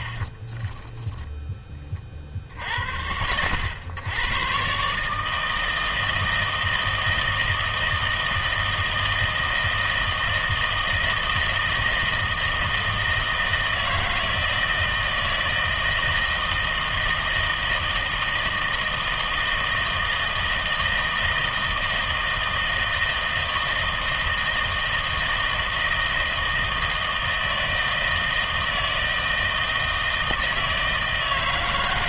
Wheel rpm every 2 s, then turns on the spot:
0, 70, 140, 160, 160, 160, 160, 160, 160, 160, 160, 160, 160, 160, 160, 160.
none